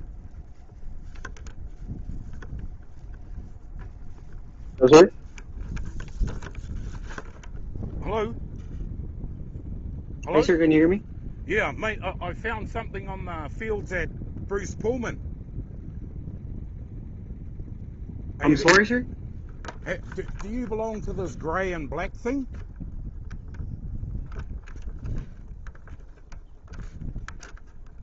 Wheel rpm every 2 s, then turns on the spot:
0, 0, 0, 0, 0, 0, 0, 0, 0, 0, 0, 0, 0, 0.
none